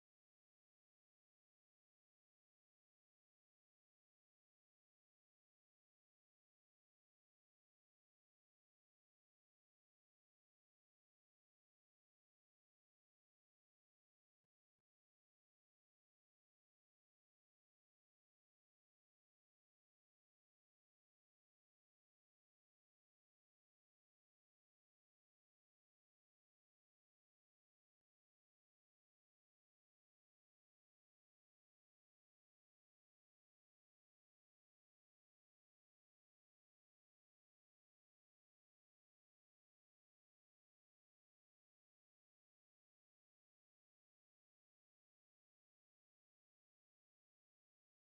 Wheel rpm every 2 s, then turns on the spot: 0, 0, 0, 0, 0, 0, 0, 0, 0, 0, 0, 0, 0, 0, 0, 0, 0, 0, 0, 0, 0, 0, 0, 0.
none